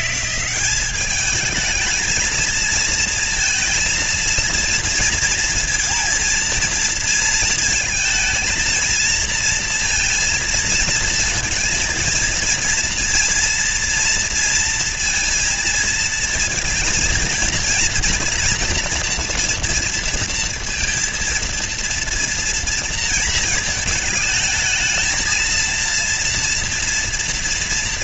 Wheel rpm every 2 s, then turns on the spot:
190, 220, 230, 230, 230, 230, 230, 230, 230, 230, 230, 230, 220, 240.
none